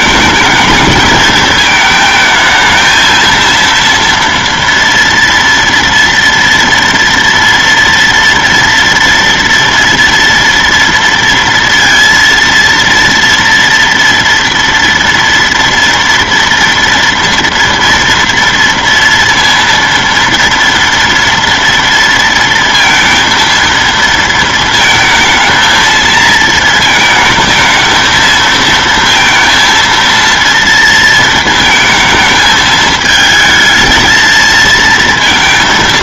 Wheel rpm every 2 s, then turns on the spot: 220, 220, 230, 230, 230, 230, 230, 230, 230, 230, 230, 230, 220, 230, 230, 230, 220, 220.
none